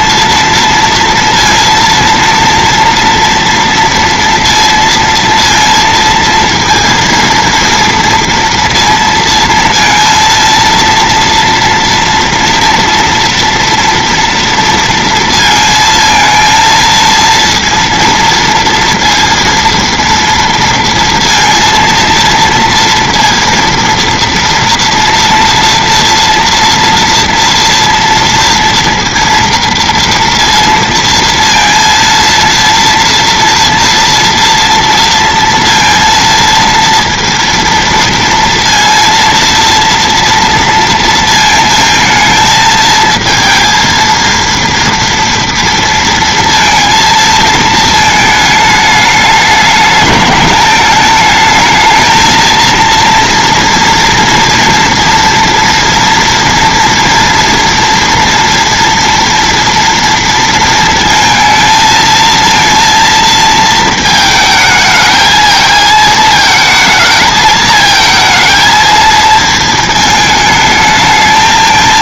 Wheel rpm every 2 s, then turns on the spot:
230, 230, 230, 230, 230, 230, 230, 230, 230, 230, 230, 230, 230, 230, 230, 230, 230, 230, 230, 230, 230, 220, 230, 230, 210, 210, 230, 230, 230, 230, 230, 230, 220, 220, 220, 210.
none